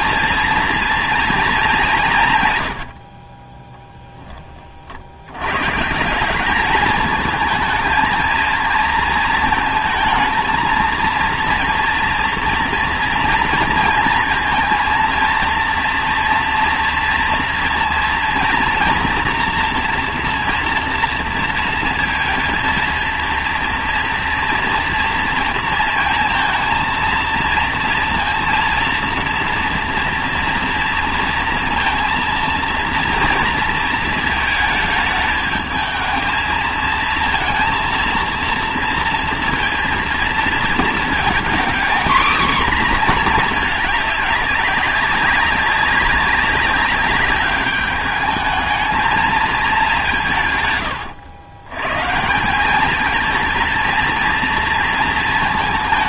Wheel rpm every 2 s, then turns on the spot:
230, 120, 30, 210, 230, 230, 230, 230, 230, 240, 240, 230, 230, 230, 230, 230, 230, 220, 220, 230, 230, 240, 200, 200, 220, 130, 190, 230.
none